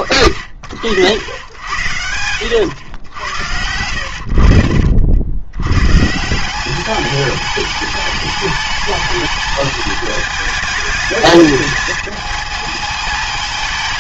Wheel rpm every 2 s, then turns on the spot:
90, 110, 70, 190, 210, 210, 220.
none